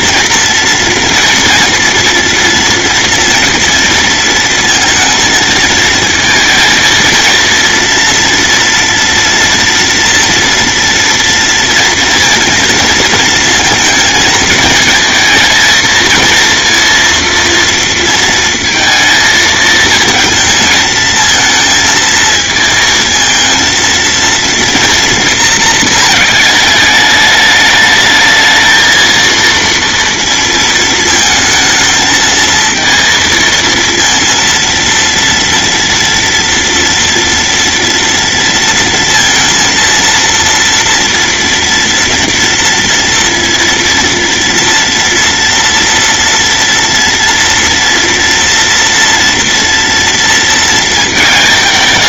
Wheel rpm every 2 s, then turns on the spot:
230, 230, 230, 230, 230, 230, 230, 220, 230, 230, 220, 220, 230, 210, 220, 230, 220, 230, 230, 230, 230, 240, 230, 230, 240, 230.
none